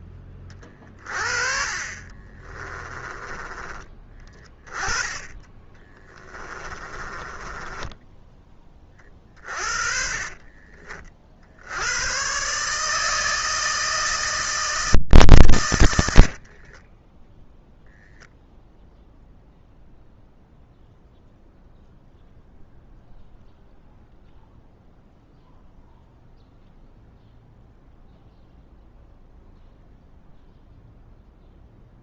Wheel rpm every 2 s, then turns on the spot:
20, 30, 20, 20, 10, 40, 130, 160, 50, 0, 0, 0, 0, 0, 0, 0.
2-4 6-8 10-12 16-18